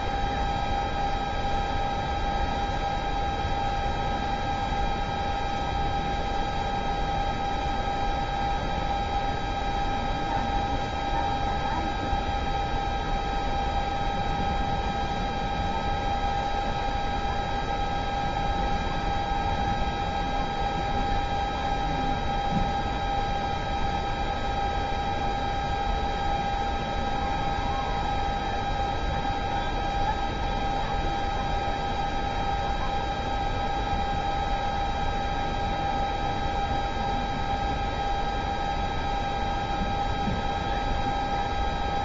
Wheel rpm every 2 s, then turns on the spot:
0, 0, 0, 0, 0, 0, 0, 0, 0, 0, 0, 0, 0, 0, 0, 0, 0, 0, 0, 0, 0.
none